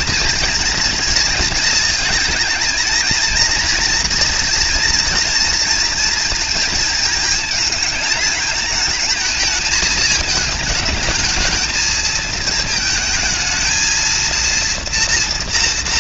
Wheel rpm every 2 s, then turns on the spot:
230, 230, 240, 220, 220, 220, 220, 240.
none